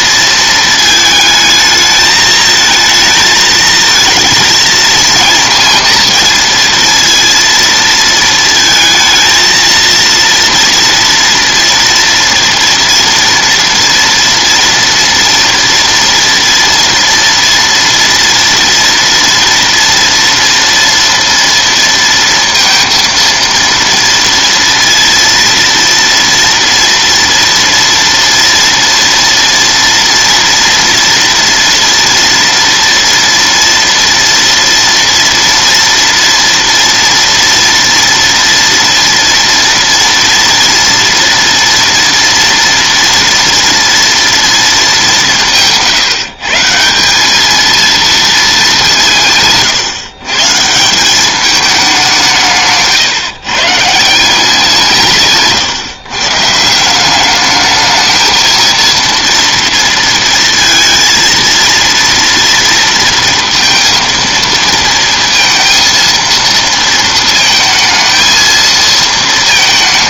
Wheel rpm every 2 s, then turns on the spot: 220, 220, 230, 230, 220, 240, 230, 230, 240, 230, 230, 230, 230, 230, 230, 230, 240, 230, 230, 230, 230, 240, 220, 160, 190, 160, 150, 180, 160, 230, 230, 230, 230, 230, 230.
none